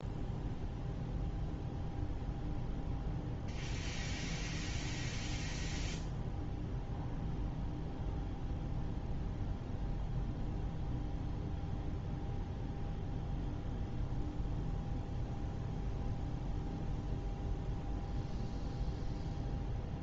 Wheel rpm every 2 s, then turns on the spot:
0, 0, 0, 0, 0, 0, 0, 0, 0, 0.
none